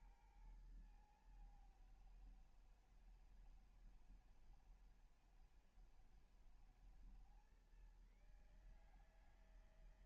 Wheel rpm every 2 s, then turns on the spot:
120, 110, 110, 120, 140.
none